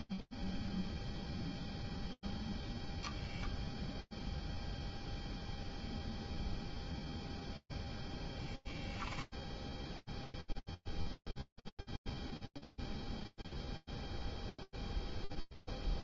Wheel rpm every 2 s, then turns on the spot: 0, 0, 0, 0, 0, 0, 0, 20.
14-16